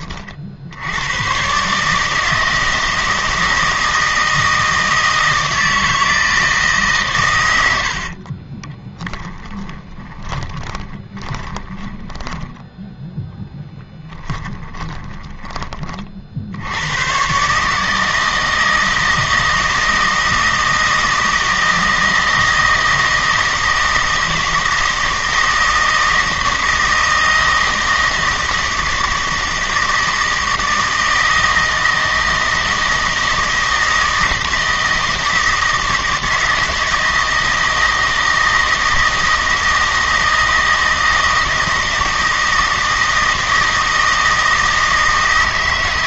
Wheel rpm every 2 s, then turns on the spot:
70, 160, 160, 150, 20, 20, 20, 10, 90, 160, 160, 160, 160, 160, 160, 160, 160, 160, 160, 160, 160, 160, 160.
8-16